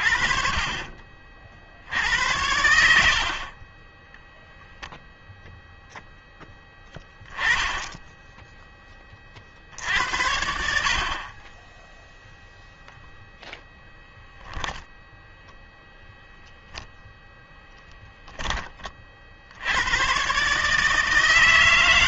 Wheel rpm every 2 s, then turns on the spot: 40, 80, 0, 10, 10, 70, 0, 0, 0, 20, 140.
none